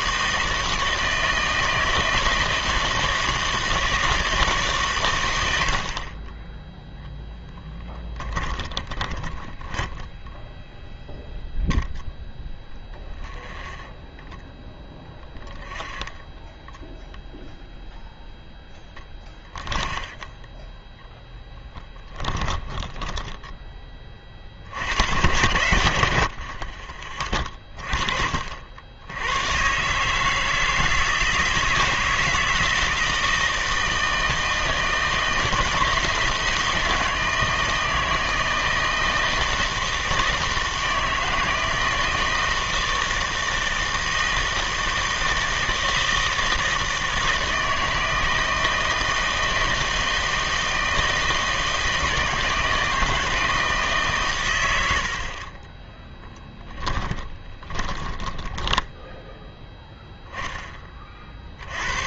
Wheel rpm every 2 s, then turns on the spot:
160, 160, 140, 10, 20, 0, 10, 10, 10, 10, 10, 20, 60, 50, 60, 160, 160, 160, 160, 160, 160, 160, 160, 160, 160, 160, 160, 90, 10, 10, 10.
8-10 12-18 22-24 56-60